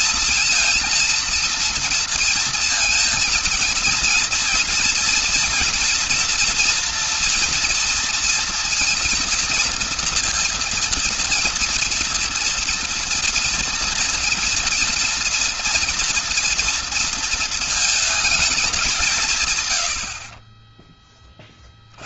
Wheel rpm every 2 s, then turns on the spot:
230, 230, 230, 230, 230, 230, 230, 230, 230, 210, 20.
none